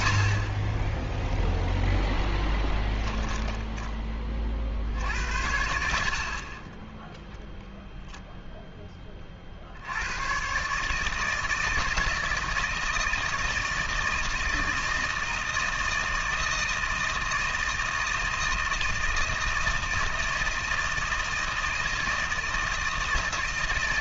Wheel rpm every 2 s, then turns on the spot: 10, 10, 70, 0, 20, 160, 160, 160, 160, 160, 160, 160.
2-4